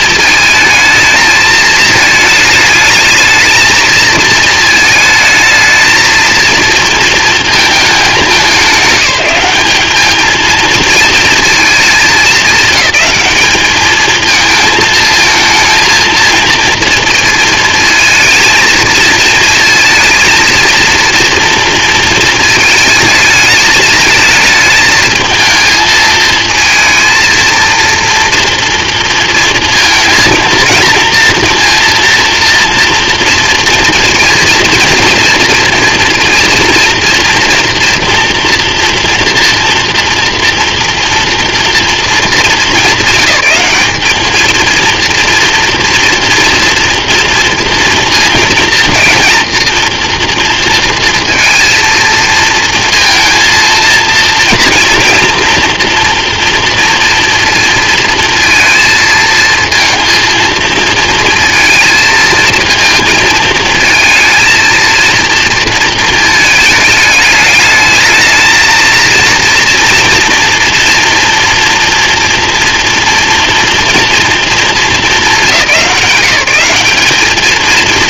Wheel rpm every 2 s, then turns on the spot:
220, 220, 220, 230, 190, 220, 220, 220, 230, 220, 230, 220, 220, 230, 230, 230, 230, 240, 230, 230, 230, 200, 230, 230, 230, 230, 230, 240, 240, 230, 230, 220, 230, 210, 230, 230, 230, 200, 210.
none